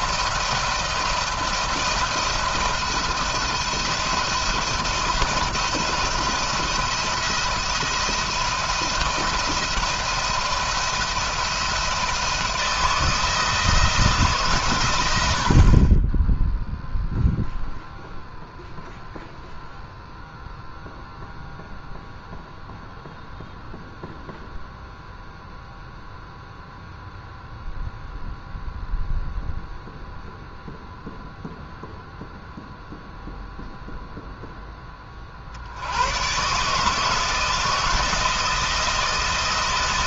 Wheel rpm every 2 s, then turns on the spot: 170, 170, 160, 170, 170, 170, 160, 100, 0, 0, 0, 0, 0, 0, 0, 0, 0, 20, 150, 160.
none